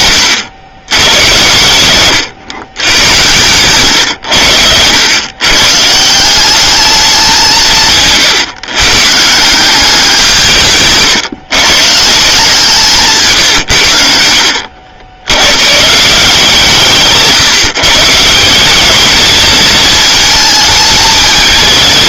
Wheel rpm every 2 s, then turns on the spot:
100, 110, 100, 200, 130, 150, 160, 70, 150, 210, 220.
none